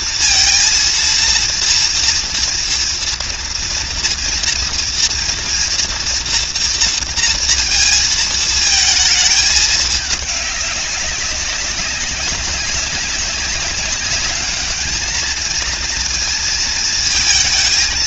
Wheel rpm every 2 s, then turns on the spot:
230, 230, 230, 230, 220, 210, 190, 210, 220.
none